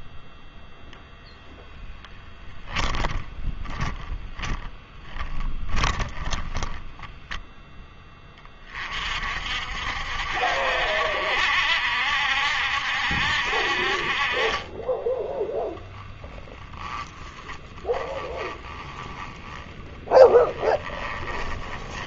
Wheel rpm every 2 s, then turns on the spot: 0, 20, 10, 10, 30, 70, 70, 20, 0, 20, 20.
2-8 14-16 18-22